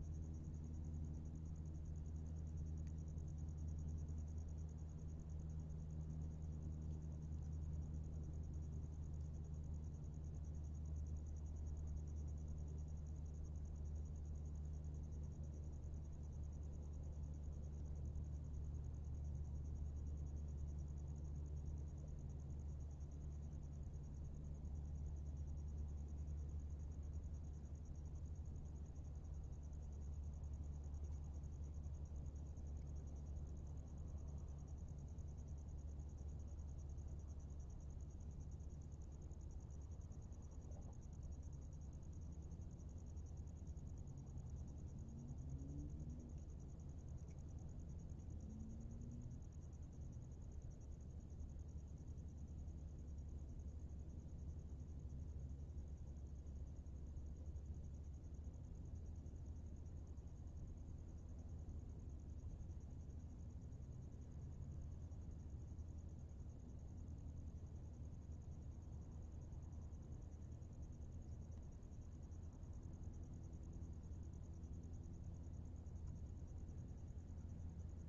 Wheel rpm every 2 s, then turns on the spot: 0, 0, 0, 0, 0, 0, 0, 0, 0, 0, 0, 0, 0, 0, 0, 0, 0, 0, 0, 0, 0, 0, 0, 0, 0, 0, 0, 0, 0, 0, 0, 0, 0, 0, 0, 0, 0, 0, 0.
none